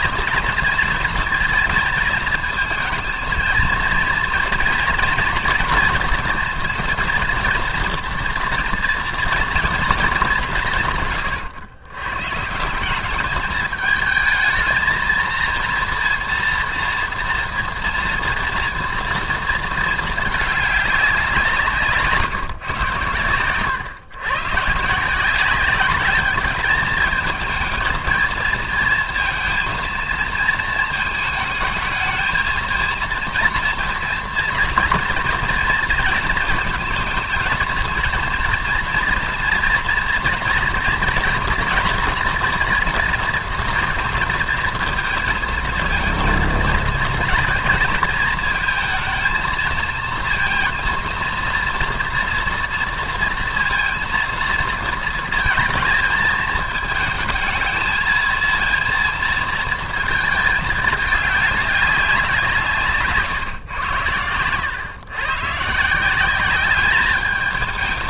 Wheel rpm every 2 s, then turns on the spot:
230, 230, 230, 230, 240, 140, 190, 220, 230, 230, 200, 120, 140, 220, 230, 230, 230, 230, 230, 230, 230, 230, 230, 230, 220, 230, 230, 230, 220, 230, 210, 150, 110, 200.
62-64